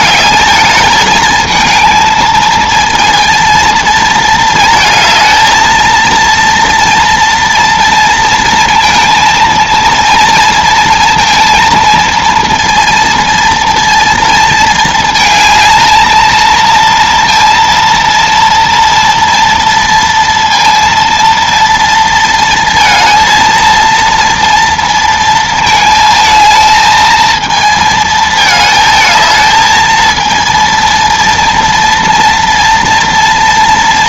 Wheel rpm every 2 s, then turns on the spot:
220, 220, 220, 230, 230, 230, 230, 230, 230, 230, 230, 230, 230, 220, 220, 230, 230.
none